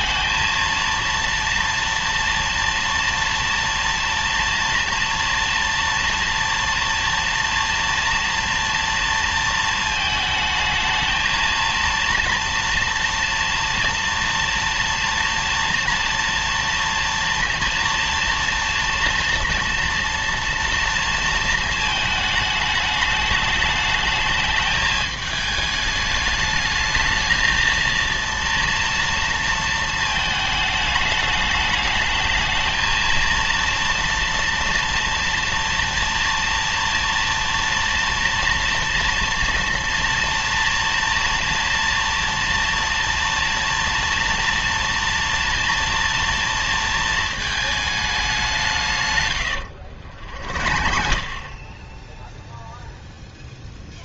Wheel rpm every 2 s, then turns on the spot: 230, 230, 230, 230, 230, 220, 230, 230, 230, 230, 230, 210, 220, 210, 230, 220, 220, 230, 230, 230, 230, 230, 230, 230, 180, 50, 0.
none